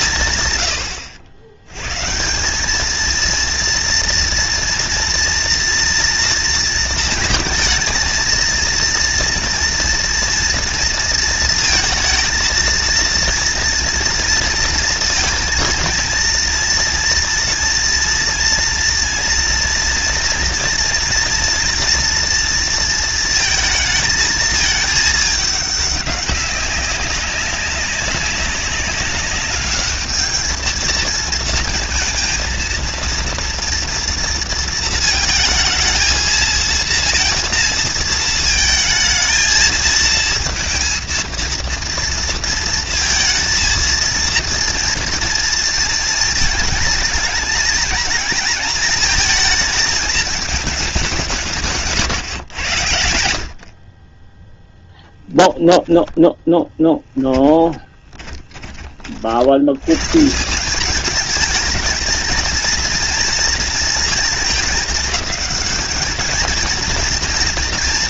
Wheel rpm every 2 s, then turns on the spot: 80, 230, 230, 220, 240, 230, 230, 230, 240, 230, 240, 220, 210, 200, 210, 230, 230, 220, 230, 220, 230, 230, 230, 220, 220, 160, 60, 10, 10, 50, 210, 230, 220, 230.
56-58